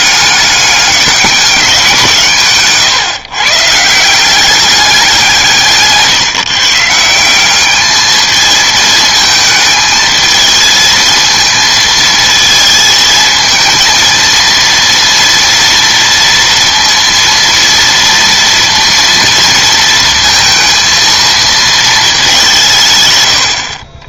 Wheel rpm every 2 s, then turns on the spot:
200, 140, 190, 150, 220, 220, 220, 230, 230, 230, 230, 190.
none